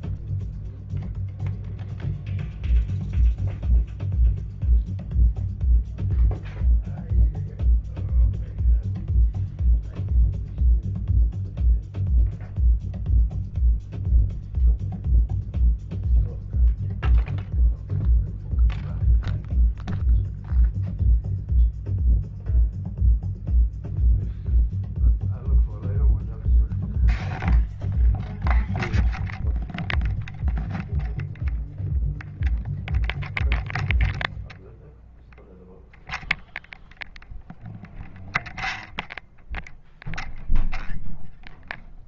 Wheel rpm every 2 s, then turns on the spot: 0, 0, 0, 0, 0, 0, 0, 0, 0, 0, 0, 0, 0, 0, 0, 0, 0, 0, 0, 0, 0.
none